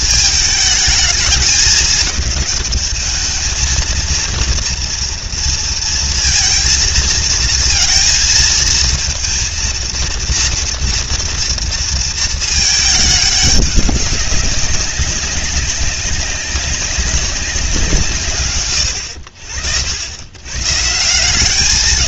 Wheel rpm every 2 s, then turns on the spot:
220, 210, 230, 220, 230, 230, 220, 200, 190, 80, 160.
none